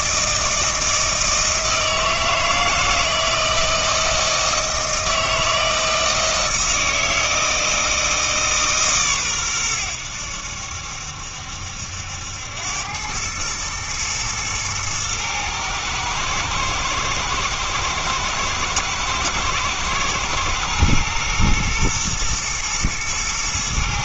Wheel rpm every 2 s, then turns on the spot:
160, 160, 160, 160, 140, 70, 90, 110, 110, 110, 120, 110.
none